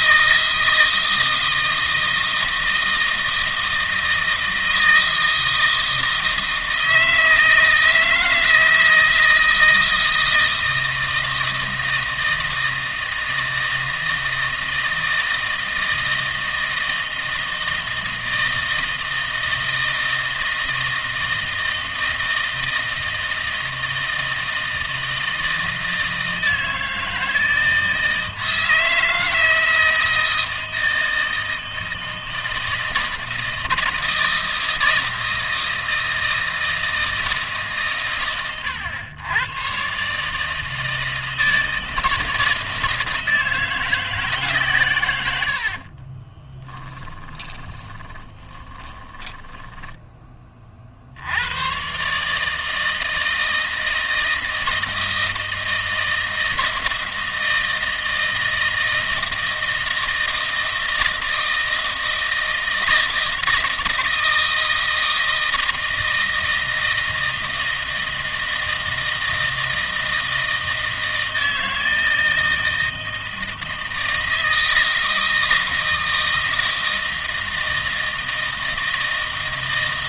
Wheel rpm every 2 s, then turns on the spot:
160, 160, 160, 160, 160, 160, 160, 160, 160, 160, 160, 160, 160, 160, 160, 160, 160, 160, 160, 110, 160, 160, 140, 10, 20, 40, 160, 160, 160, 160, 160, 160, 160, 160, 160, 160, 160, 160, 160, 160.
46-50